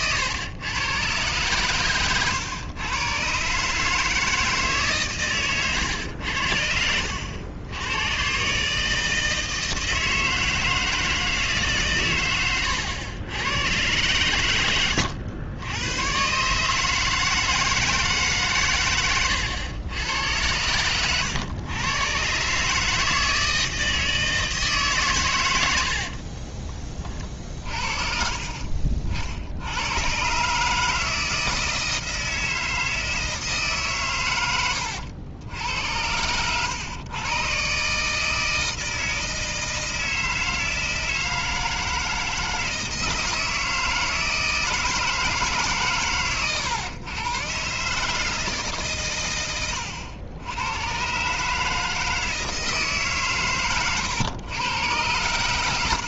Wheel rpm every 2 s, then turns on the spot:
120, 110, 140, 70, 150, 160, 110, 90, 150, 120, 100, 150, 150, 30, 50, 150, 160, 100, 110, 160, 160, 160, 160, 120, 140, 110, 160, 110.
34-36